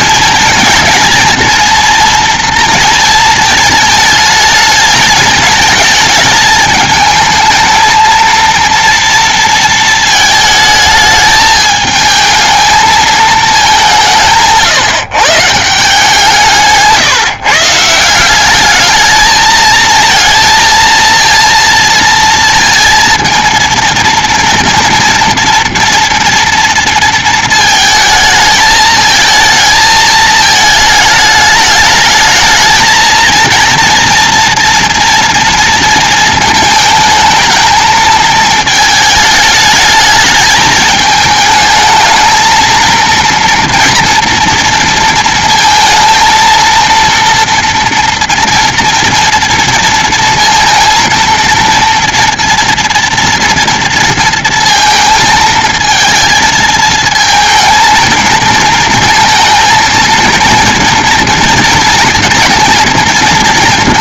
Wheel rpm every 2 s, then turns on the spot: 220, 230, 220, 220, 230, 220, 220, 170, 160, 190, 220, 230, 230, 230, 220, 220, 220, 230, 220, 220, 220, 220, 230, 230, 230, 230, 240, 230, 220, 230, 230, 230.
none